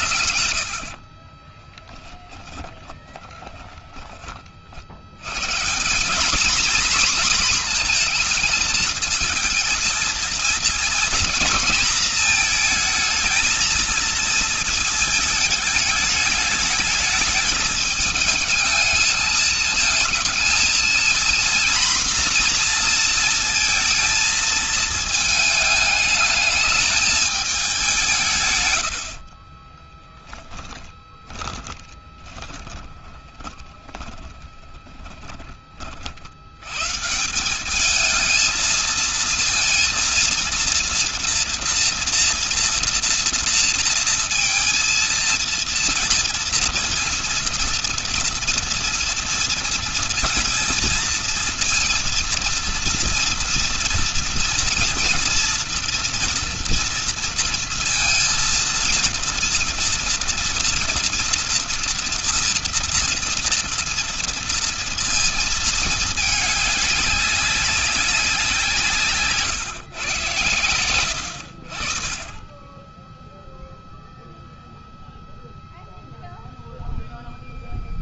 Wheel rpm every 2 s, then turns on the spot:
60, 20, 100, 250, 220, 230, 220, 220, 210, 210, 230, 230, 220, 210, 40, 20, 20, 30, 160, 230, 230, 230, 230, 230, 230, 220, 230, 230, 230, 230, 240, 230, 230, 200, 160, 80, 0, 0, 0.
0-4 28-34